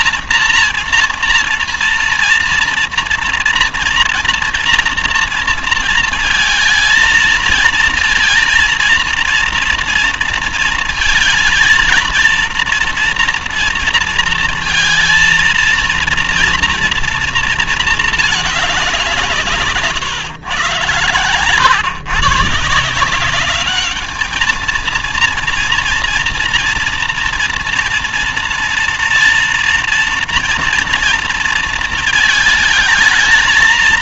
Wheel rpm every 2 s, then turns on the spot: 230, 230, 240, 230, 230, 230, 230, 230, 230, 200, 130, 160, 230, 230, 230, 230, 220.
none